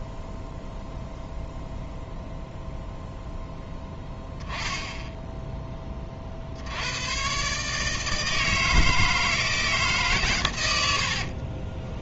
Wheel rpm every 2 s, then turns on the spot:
0, 0, 10, 60, 160, 100.
none